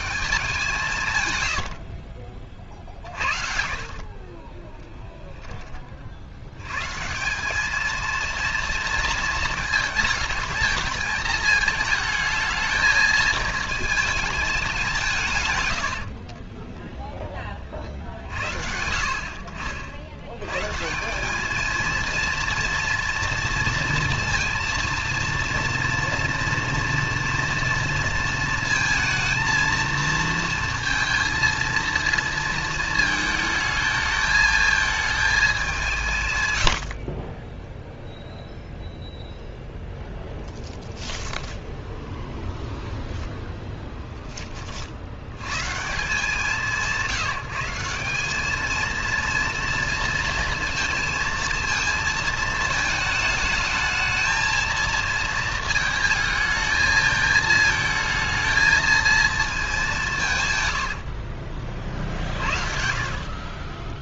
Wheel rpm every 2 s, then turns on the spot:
170, 50, 10, 160, 230, 220, 220, 160, 20, 70, 220, 240, 230, 230, 230, 230, 220, 220, 20, 0, 10, 0, 70, 160, 230, 230, 220, 220, 220, 230, 40, 50.
2-6 40-42 60-64